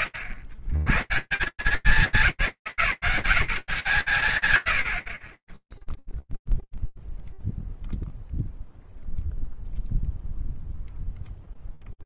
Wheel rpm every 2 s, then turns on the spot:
130, 170, 100, 0, 0, 0.
none